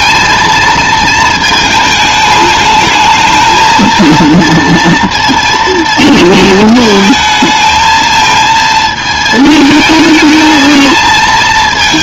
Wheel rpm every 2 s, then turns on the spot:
230, 210, 230, 220, 220, 220.
none